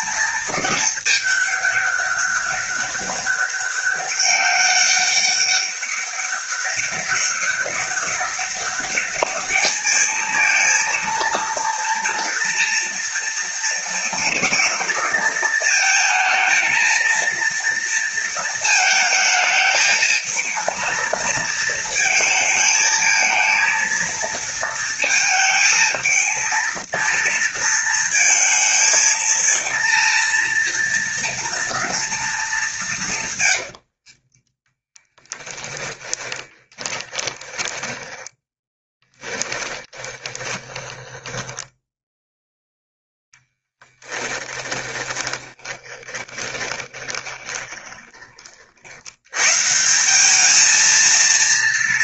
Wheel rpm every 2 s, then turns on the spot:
210, 200, 200, 200, 210, 230, 230, 230, 230, 220, 230, 220, 230, 230, 230, 230, 150, 20, 20, 10, 30, 0, 10, 30, 80, 230.
32-42 44-48